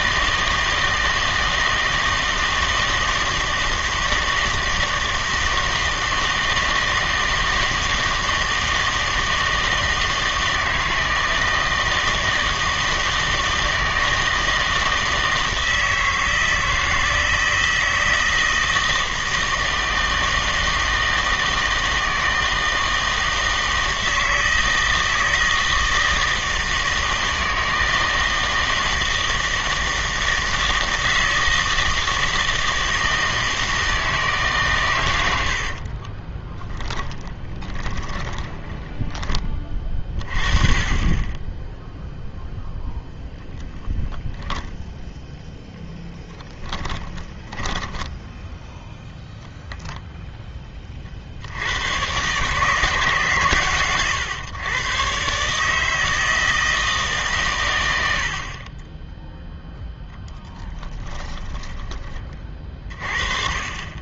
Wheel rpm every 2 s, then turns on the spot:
160, 160, 160, 160, 160, 160, 160, 160, 160, 160, 160, 160, 160, 160, 160, 160, 160, 130, 20, 10, 30, 0, 10, 10, 0, 20, 140, 120, 160, 20, 20, 40.
36-40 46-48 58-62